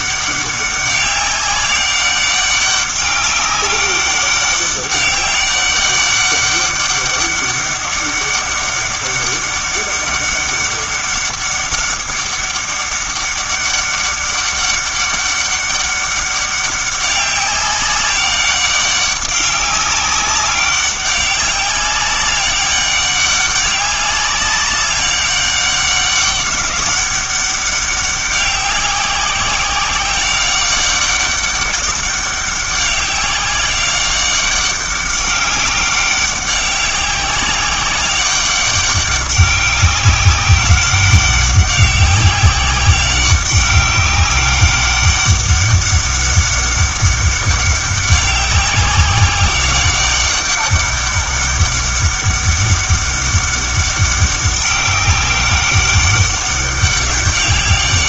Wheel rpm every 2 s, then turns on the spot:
200, 200, 200, 200, 200, 200, 200, 200, 200, 200, 200, 200, 200, 200, 190, 190, 200, 200, 190, 200, 200, 190, 200, 200, 190, 200, 200, 200, 200.
none